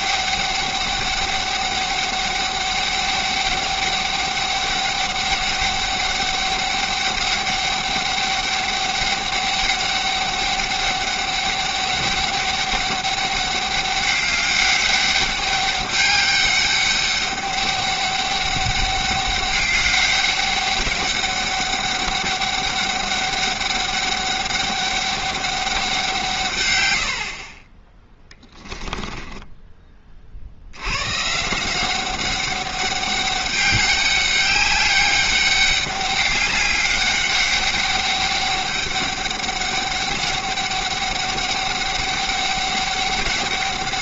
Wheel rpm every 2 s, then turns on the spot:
200, 200, 200, 200, 200, 200, 200, 200, 200, 200, 200, 200, 200, 110, 10, 70, 190, 200, 200, 200, 200, 200.
28-30